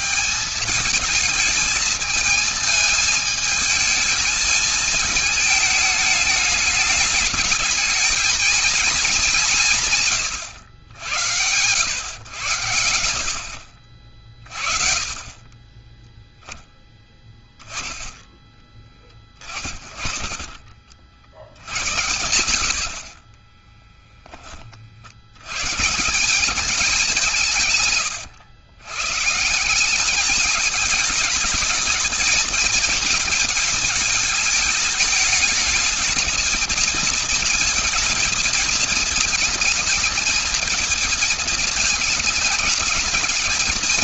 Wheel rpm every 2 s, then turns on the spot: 190, 220, 220, 210, 220, 100, 110, 40, 0, 20, 30, 90, 30, 190, 120, 200, 220, 210, 220, 220, 220, 220.
22-24